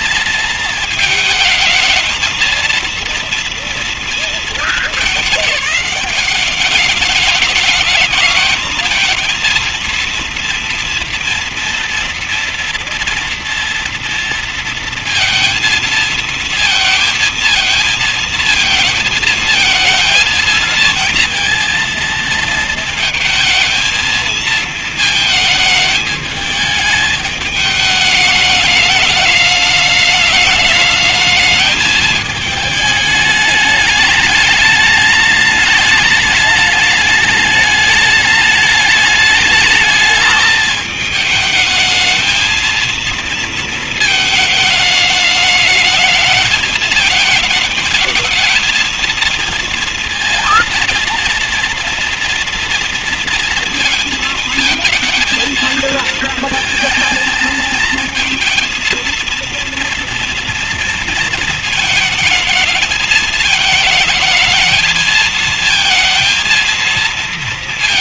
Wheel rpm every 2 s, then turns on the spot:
220, 230, 220, 210, 220, 230, 230, 230, 230, 220, 220, 230, 230, 210, 210, 210, 210, 210, 210, 210, 220, 230, 210, 220, 230, 230, 230, 230, 230, 230, 230, 220, 220, 230.
none